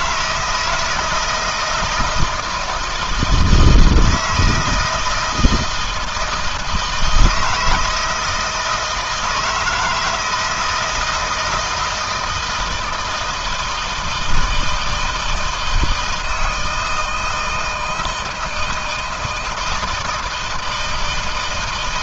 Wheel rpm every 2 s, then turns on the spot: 170, 160, 160, 160, 160, 160, 160, 160, 160, 160, 160.
none